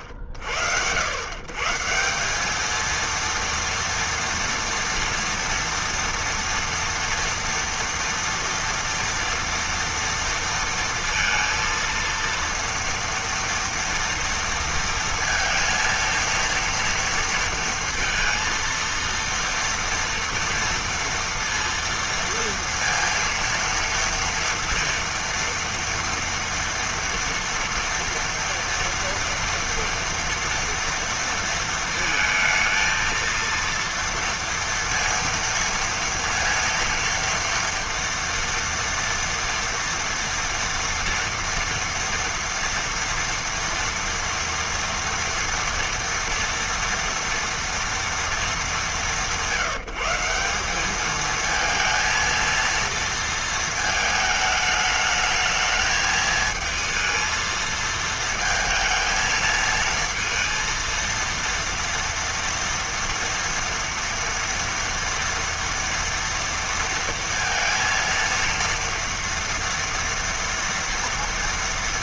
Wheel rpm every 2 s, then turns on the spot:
110, 230, 230, 230, 230, 230, 230, 230, 230, 230, 230, 230, 230, 230, 230, 230, 230, 230, 230, 230, 230, 230, 230, 230, 180, 200, 230, 210, 220, 220, 230, 230, 230, 230, 230, 230.
none